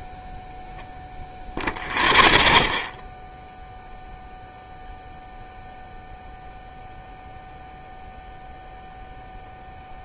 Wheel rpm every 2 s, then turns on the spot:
0, 0, 0, 0, 0.
none